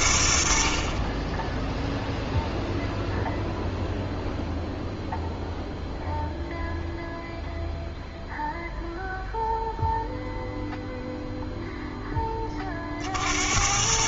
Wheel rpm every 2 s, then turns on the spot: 50, 0, 0, 0, 0, 0, 30.
none